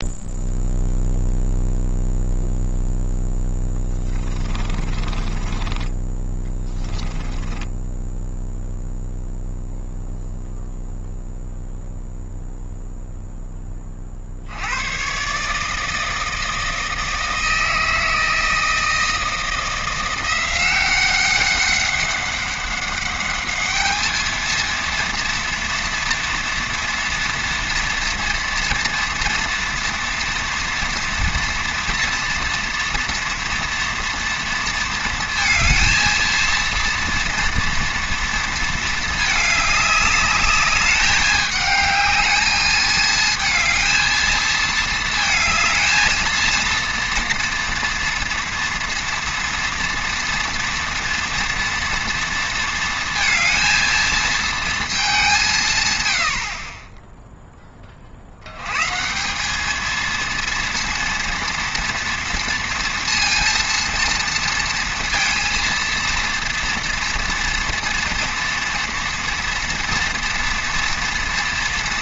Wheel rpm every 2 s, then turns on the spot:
0, 0, 20, 20, 0, 0, 0, 70, 160, 160, 180, 200, 230, 230, 230, 230, 230, 230, 230, 230, 210, 220, 220, 220, 230, 240, 230, 230, 60, 90, 230, 230, 230, 230, 240, 230.
4-8